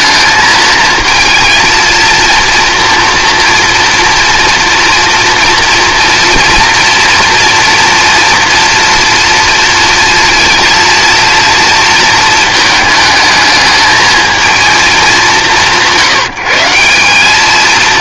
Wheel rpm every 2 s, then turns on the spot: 220, 240, 230, 240, 240, 230, 220, 220, 170.
none